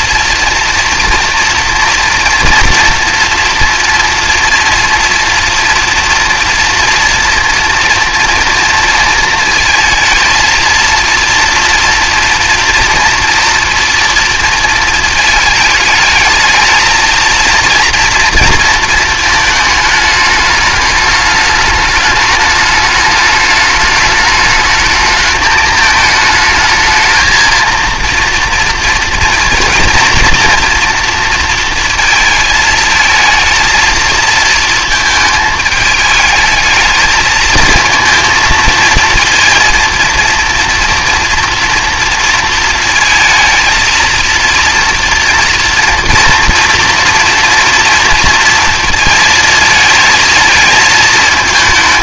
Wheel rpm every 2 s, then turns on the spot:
230, 230, 230, 230, 230, 230, 230, 230, 220, 230, 210, 210, 220, 220, 230, 230, 220, 220, 220, 230, 240, 220, 230, 240, 230, 220.
none